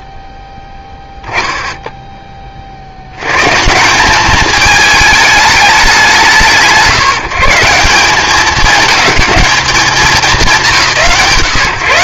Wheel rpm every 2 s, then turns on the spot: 0, 130, 210, 130, 210, 100.
none